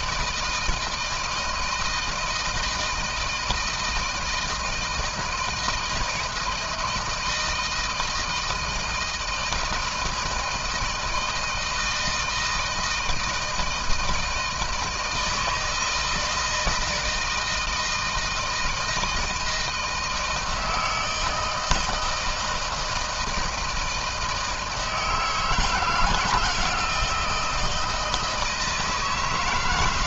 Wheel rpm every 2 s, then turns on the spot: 160, 160, 160, 160, 160, 160, 160, 160, 160, 160, 160, 160, 160, 170, 160.
none